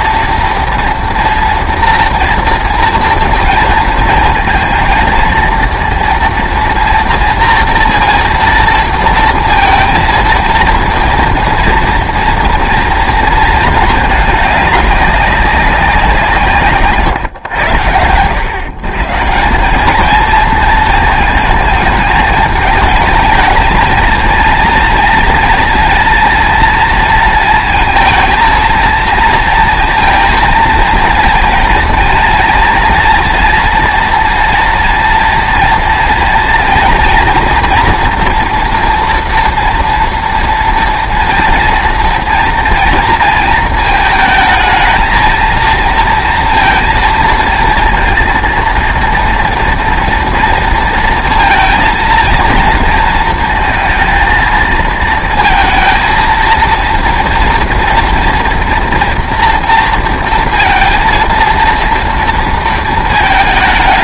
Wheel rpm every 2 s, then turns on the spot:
230, 230, 230, 240, 230, 230, 230, 210, 150, 130, 230, 220, 230, 230, 230, 220, 230, 240, 230, 230, 230, 230, 220, 230, 230, 230, 230, 220, 230, 230, 230, 230.
16-18